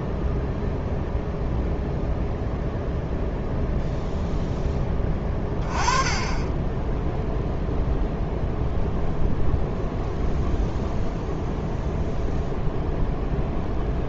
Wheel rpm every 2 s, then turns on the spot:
0, 0, 10, 20, 0, 0, 0.
none